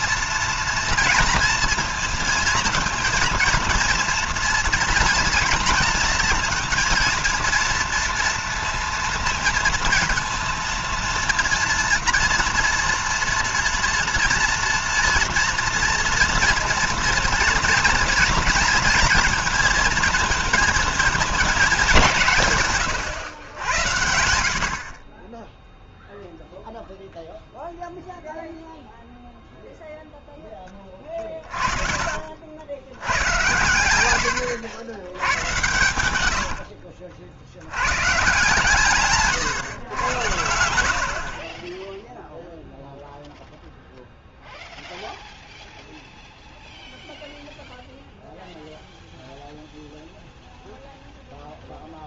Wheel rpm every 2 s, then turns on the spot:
230, 230, 230, 230, 230, 230, 240, 230, 230, 230, 220, 120, 50, 0, 0, 10, 80, 100, 70, 150, 80, 0, 0, 0, 0, 0.
36-38